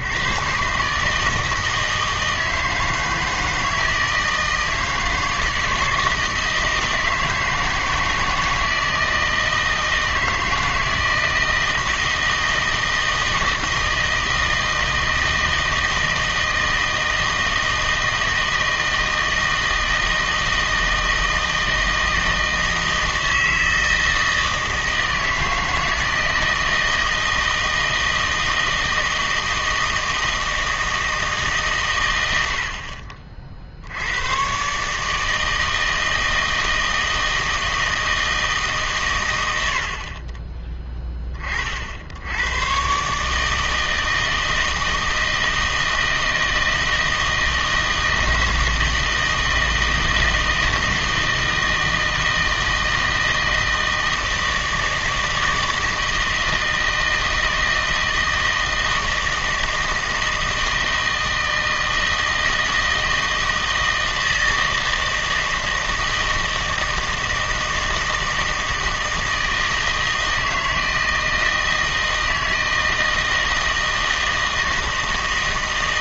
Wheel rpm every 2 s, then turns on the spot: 130, 160, 160, 160, 160, 160, 160, 160, 160, 160, 160, 160, 160, 160, 160, 160, 60, 130, 160, 140, 20, 120, 160, 160, 160, 160, 160, 160, 160, 160, 160, 160, 160, 160, 160, 160, 160, 160.
none